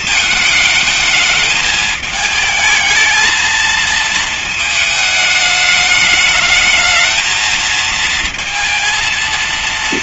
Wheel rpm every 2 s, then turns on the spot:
220, 220, 220, 220, 230.
none